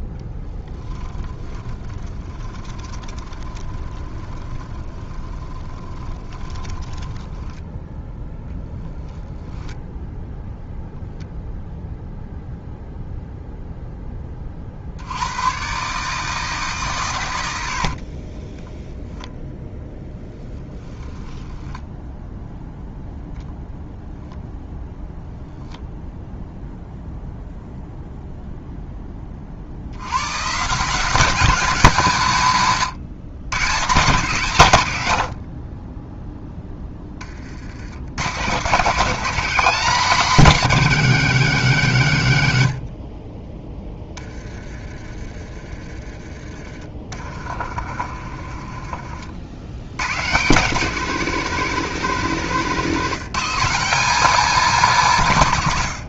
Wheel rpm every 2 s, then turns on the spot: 0, 20, 30, 10, 10, 0, 0, 50, 150, 10, 10, 0, 0, 0, 0, 150, 140, 130, 10, 160, 210, 80, 20, 30, 30, 170, 180, 220.
2-10 18-22 46-50